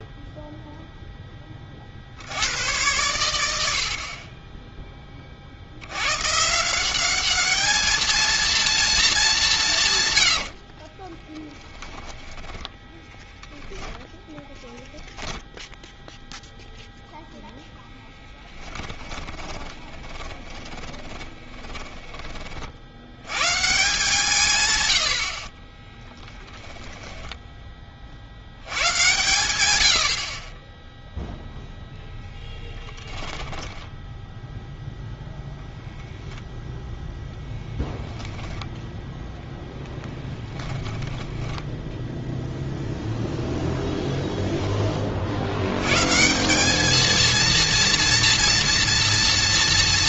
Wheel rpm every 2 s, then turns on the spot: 0, 90, 10, 160, 230, 70, 20, 10, 0, 10, 10, 50, 140, 10, 90, 20, 10, 0, 0, 0, 10, 0, 10, 190, 230.
10-16 18-22 26-28 32-34 40-42